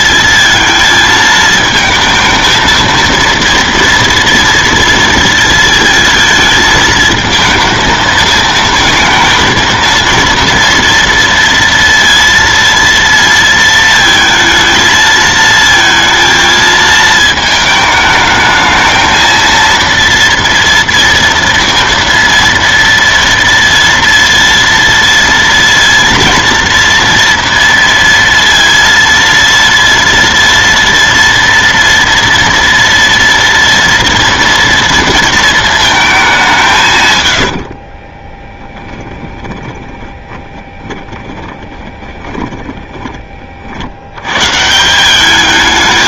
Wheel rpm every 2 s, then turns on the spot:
230, 230, 230, 220, 220, 230, 230, 220, 220, 220, 230, 230, 230, 230, 230, 230, 230, 230, 180, 20, 20, 20, 130.
38-44